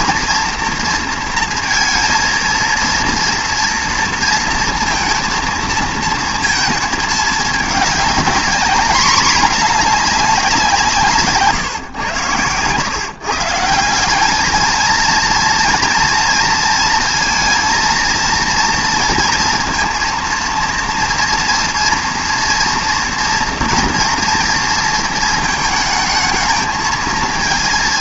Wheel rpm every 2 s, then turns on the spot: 240, 230, 230, 220, 220, 170, 110, 220, 230, 230, 230, 230, 230, 220.
none